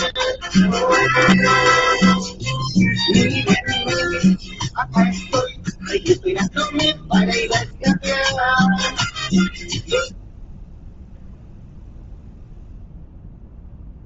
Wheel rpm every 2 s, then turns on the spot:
0, 0, 0, 0, 0, 0, 0.
none